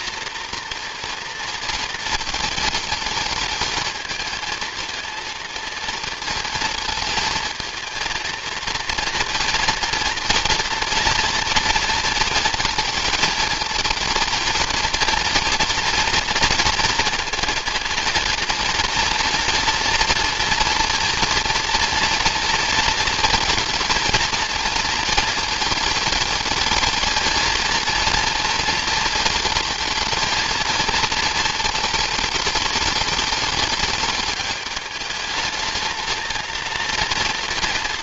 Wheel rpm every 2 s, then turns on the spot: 230, 220, 230, 230, 230, 230, 220, 230, 230, 230, 230, 230, 230, 220, 230, 230, 210, 210, 220.
none